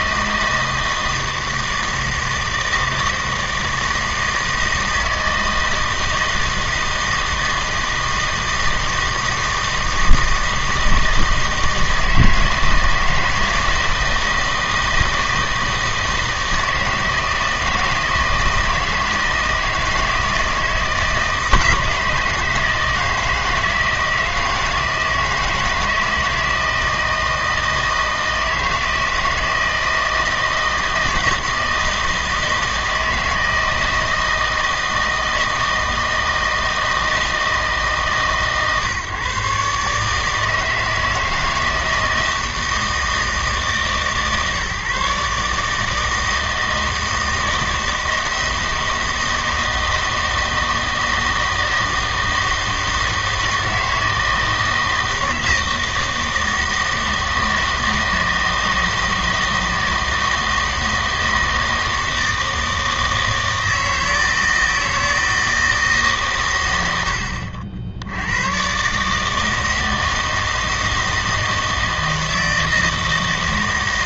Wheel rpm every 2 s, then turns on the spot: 160, 160, 160, 160, 160, 160, 160, 160, 160, 160, 160, 160, 160, 160, 160, 160, 160, 160, 160, 140, 160, 160, 140, 160, 160, 160, 160, 160, 160, 160, 160, 160, 160, 110, 120, 160, 160.
none